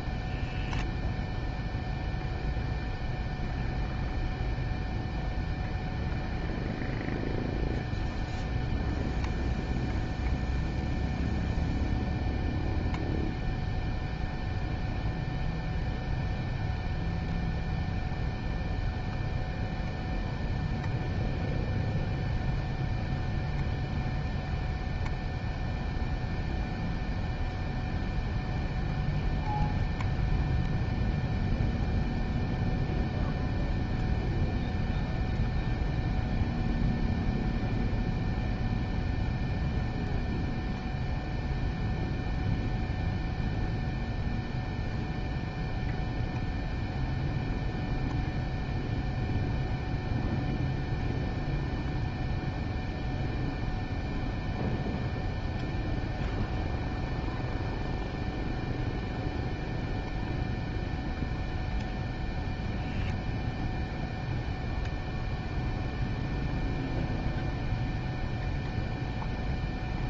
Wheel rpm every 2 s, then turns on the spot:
0, 0, 0, 0, 0, 0, 0, 0, 0, 0, 0, 0, 0, 0, 0, 0, 0, 0, 0, 0, 0, 0, 0, 0, 0, 0, 0, 0, 0, 0, 0, 0, 0, 0, 0.
none